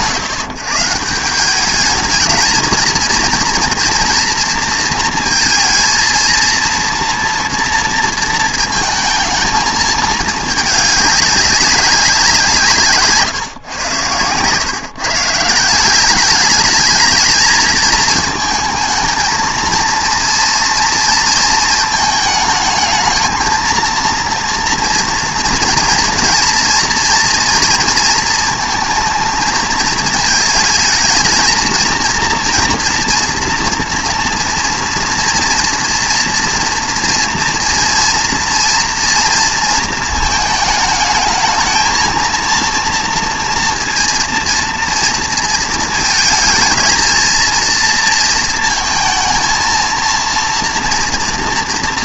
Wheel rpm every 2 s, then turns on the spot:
150, 230, 230, 230, 220, 210, 160, 140, 210, 220, 230, 220, 240, 240, 230, 220, 230, 230, 240, 230, 220, 230, 230, 230, 230, 230.
none